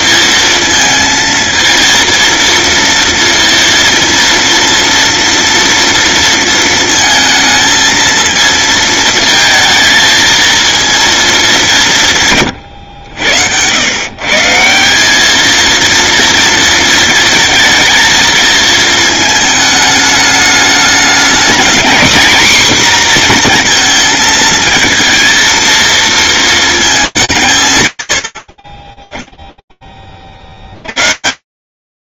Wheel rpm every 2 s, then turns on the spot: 230, 230, 230, 220, 220, 220, 90, 200, 230, 220, 220, 250, 230, 200, 10, 130.
12-14